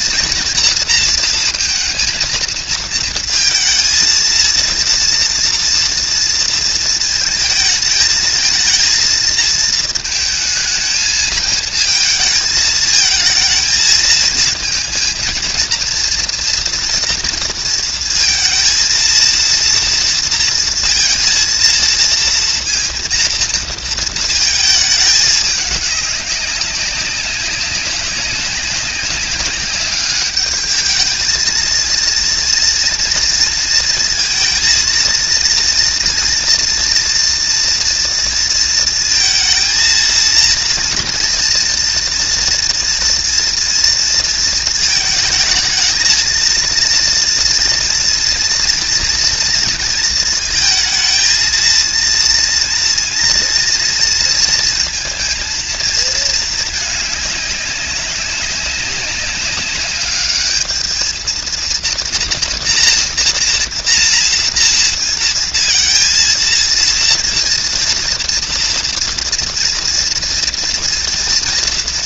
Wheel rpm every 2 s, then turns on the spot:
230, 230, 230, 230, 220, 220, 220, 230, 230, 230, 230, 230, 220, 200, 200, 210, 230, 220, 230, 230, 230, 230, 220, 230, 230, 230, 230, 230, 220, 190, 210, 240, 230, 230, 230, 230.
none